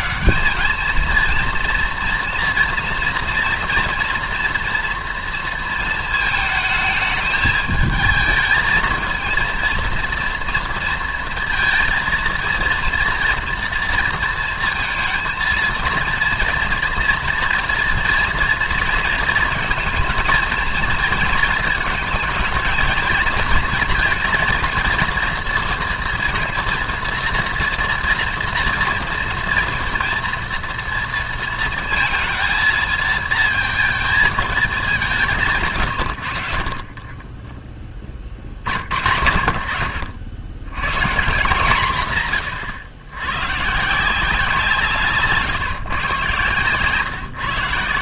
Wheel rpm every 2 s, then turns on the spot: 210, 230, 240, 220, 220, 230, 230, 230, 240, 230, 220, 220, 230, 230, 230, 230, 230, 210, 60, 60, 90, 130, 170, 130.
none